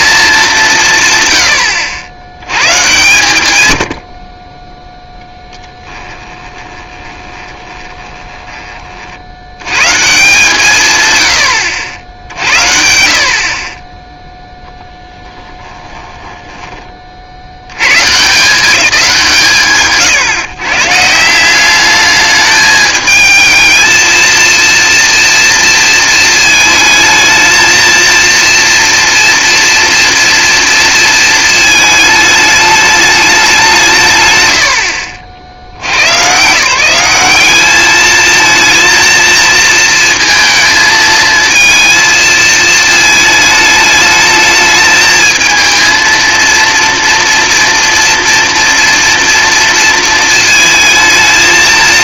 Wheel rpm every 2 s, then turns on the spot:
150, 120, 10, 20, 40, 140, 60, 10, 20, 190, 150, 210, 230, 220, 230, 230, 210, 90, 170, 230, 230, 220, 220, 230, 230, 220.
4-8 14-18